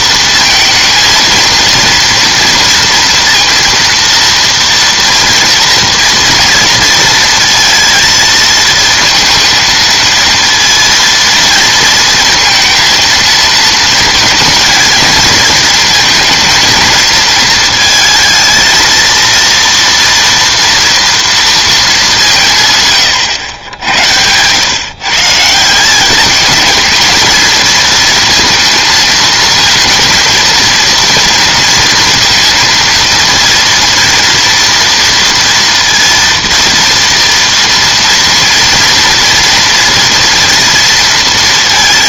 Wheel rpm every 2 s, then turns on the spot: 230, 230, 230, 220, 230, 230, 220, 230, 220, 230, 230, 90, 170, 220, 230, 230, 230, 230, 230, 230, 230.
none